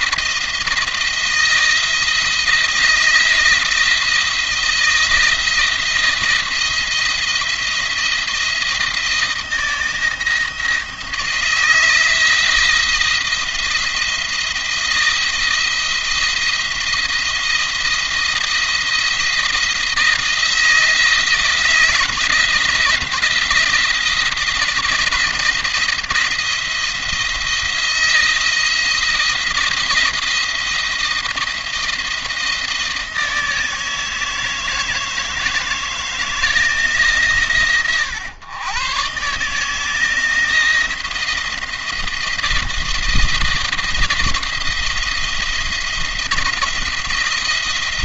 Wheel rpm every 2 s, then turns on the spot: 170, 170, 170, 170, 170, 170, 170, 170, 170, 160, 170, 170, 160, 170, 170, 170, 160, 160, 150, 130, 170, 170, 170, 170.
none